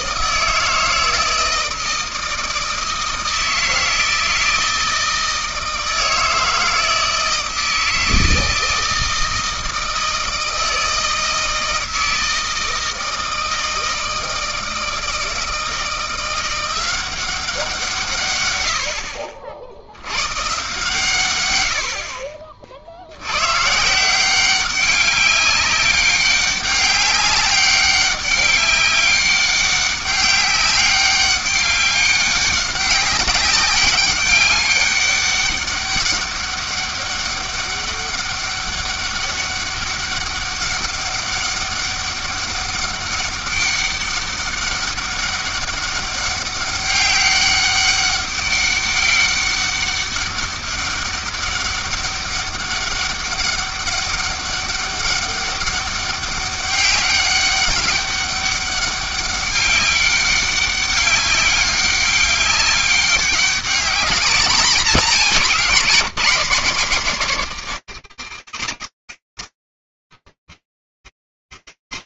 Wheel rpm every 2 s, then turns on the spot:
160, 160, 160, 160, 160, 160, 160, 160, 180, 90, 130, 60, 190, 200, 190, 200, 200, 200, 200, 200, 200, 200, 200, 200, 200, 200, 200, 200, 200, 200, 200, 200, 200, 160, 30, 70.
none